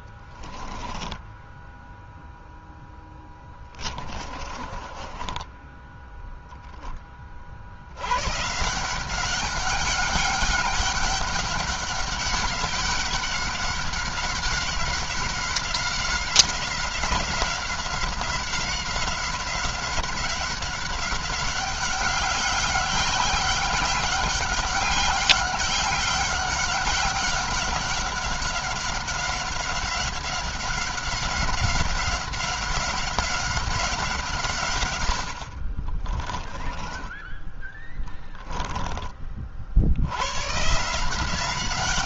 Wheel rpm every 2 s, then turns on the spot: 10, 0, 20, 10, 160, 200, 200, 190, 190, 190, 190, 190, 200, 190, 190, 190, 190, 130, 20, 20, 140.
0-2 4-6